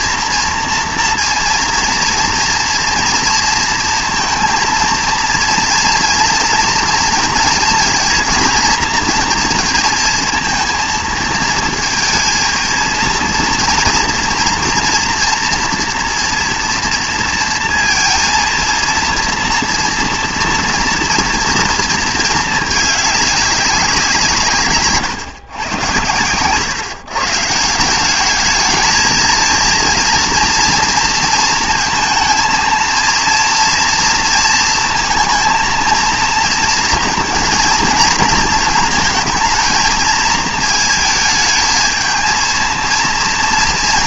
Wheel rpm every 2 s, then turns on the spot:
230, 230, 230, 230, 230, 230, 230, 230, 230, 230, 230, 220, 140, 120, 220, 230, 230, 230, 230, 230, 220, 220.
none